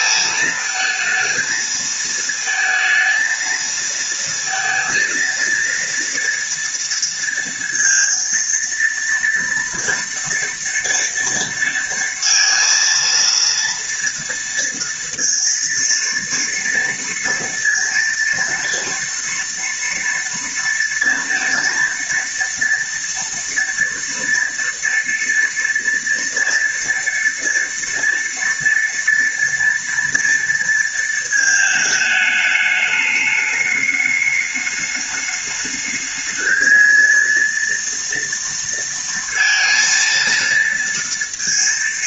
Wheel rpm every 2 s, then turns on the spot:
220, 220, 230, 230, 230, 230, 230, 230, 230, 230, 230, 230, 230, 230, 230, 230, 210, 210, 220, 230, 230.
none